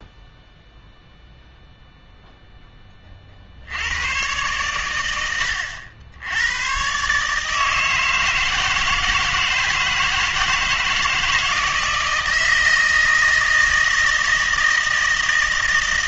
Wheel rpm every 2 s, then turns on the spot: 0, 10, 110, 110, 160, 160, 160, 160.
none